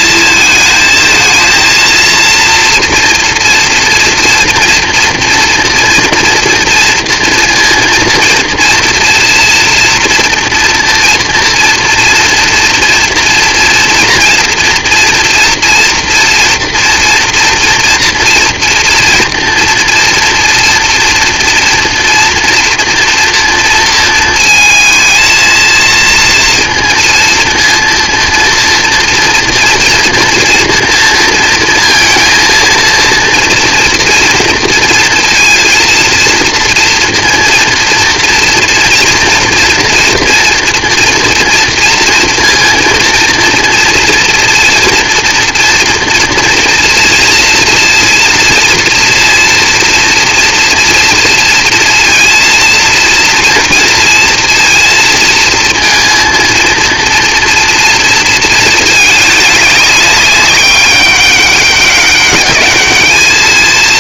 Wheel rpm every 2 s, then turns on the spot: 220, 240, 230, 230, 230, 230, 230, 230, 230, 230, 230, 230, 220, 230, 230, 230, 230, 230, 240, 230, 240, 230, 240, 230, 230, 230, 230, 230, 230, 220, 200, 210.
none